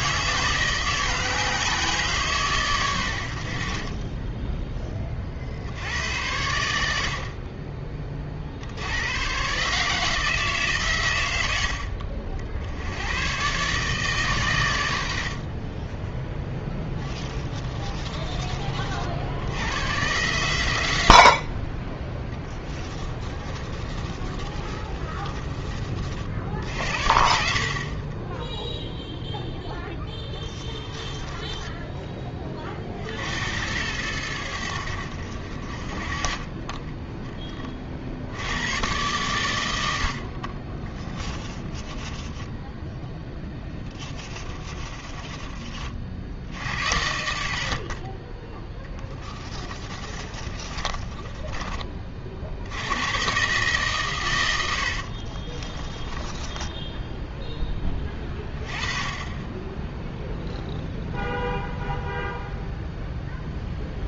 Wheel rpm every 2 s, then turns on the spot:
160, 140, 10, 90, 60, 150, 70, 130, 10, 30, 110, 20, 30, 60, 10, 10, 20, 90, 30, 80, 50, 10, 20, 70, 20, 30, 50, 110, 20, 20, 0, 0.
4-6 22-26 30-32 40-46 50-52 56-58